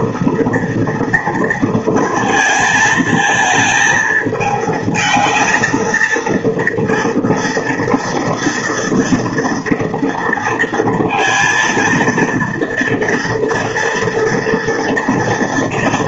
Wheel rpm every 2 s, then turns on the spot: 230, 220, 220, 230, 230, 230, 230, 230.
none